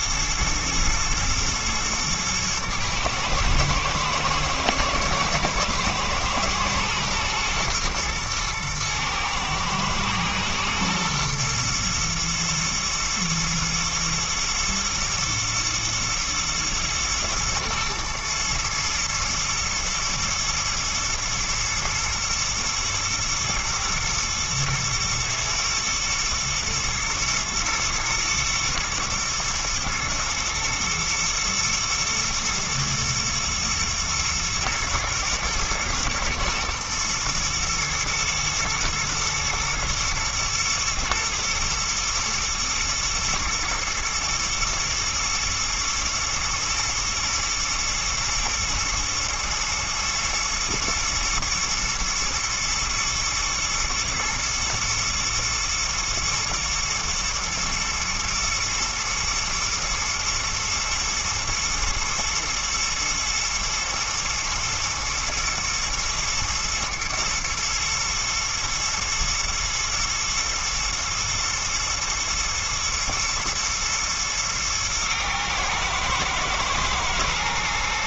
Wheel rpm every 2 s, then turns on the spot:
110, 110, 110, 110, 120, 120, 120, 120, 110, 110, 120, 110, 120, 120, 110, 110, 110, 110, 110, 120, 120, 110, 110, 110, 110, 110, 120, 110, 110, 120, 120, 120, 110, 110, 120, 110, 110, 110, 110.
none